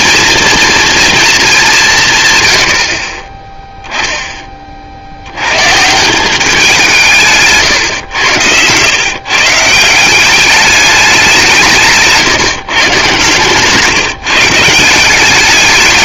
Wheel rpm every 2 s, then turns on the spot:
230, 100, 30, 190, 110, 210, 130, 160.
none